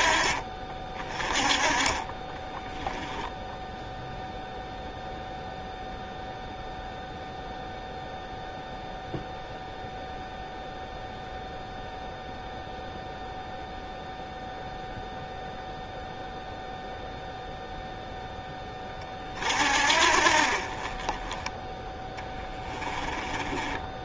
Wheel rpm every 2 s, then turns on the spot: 30, 10, 0, 0, 0, 0, 0, 0, 0, 20, 40, 10.
2-4 22-24